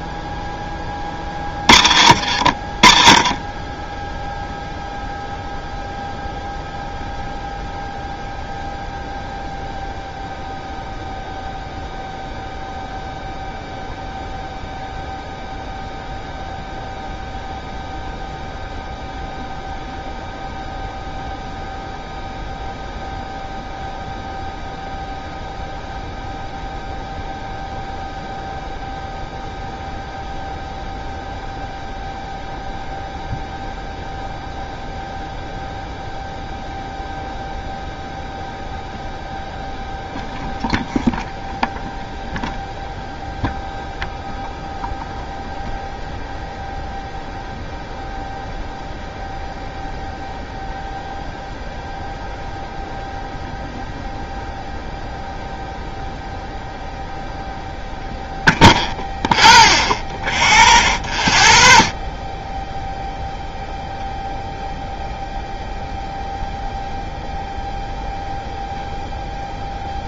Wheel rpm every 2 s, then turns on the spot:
10, 60, 0, 0, 0, 0, 0, 0, 0, 0, 0, 0, 0, 0, 0, 0, 0, 0, 0, 0, 0, 0, 0, 0, 0, 0, 0, 0, 0, 0, 0, 0, 0, 0, 0.
2-4